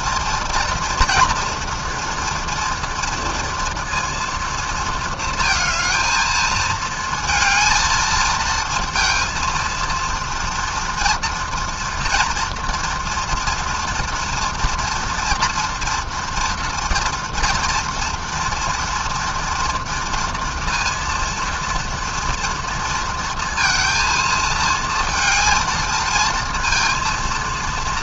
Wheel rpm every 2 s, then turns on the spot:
230, 230, 220, 220, 230, 230, 230, 230, 230, 230, 230, 230, 230, 230.
none